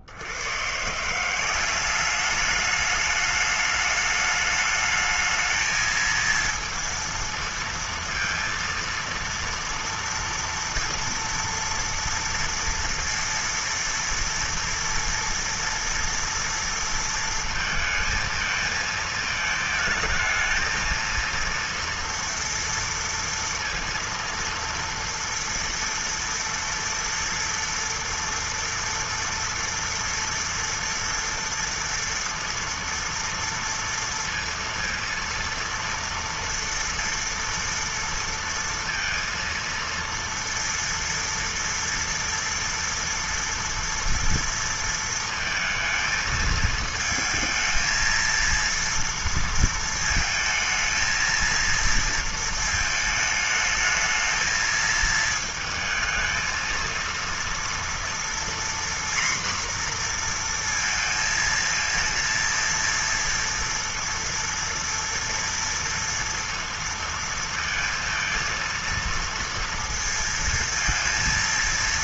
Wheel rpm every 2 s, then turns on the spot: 80, 200, 210, 230, 230, 230, 230, 230, 230, 230, 220, 230, 230, 230, 230, 230, 230, 230, 230, 230, 230, 230, 230, 220, 230, 230, 230, 220, 220, 240, 240, 230, 230, 230, 230, 230.
none